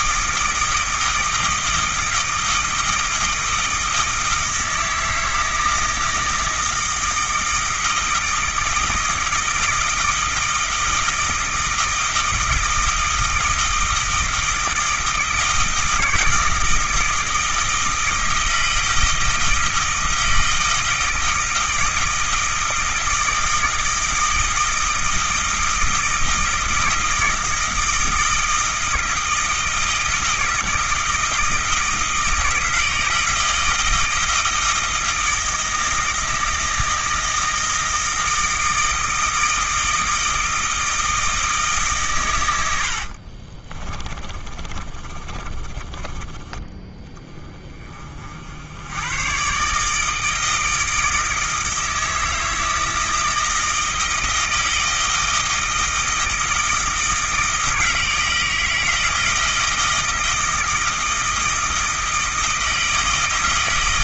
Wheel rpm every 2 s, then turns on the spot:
160, 160, 160, 160, 160, 160, 160, 160, 160, 160, 160, 160, 160, 160, 160, 160, 160, 160, 160, 160, 160, 90, 40, 20, 80, 160, 160, 160, 160, 160, 160, 160.
42-46